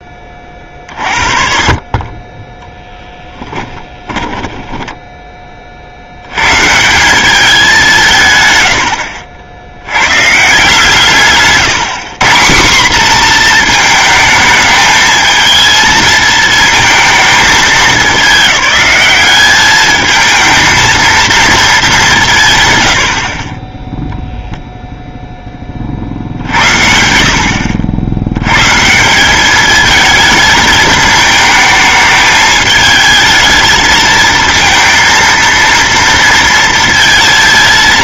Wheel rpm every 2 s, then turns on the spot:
40, 10, 10, 140, 110, 150, 190, 220, 220, 200, 220, 140, 0, 70, 140, 220, 220, 230, 230.
4-6 8-10 26-28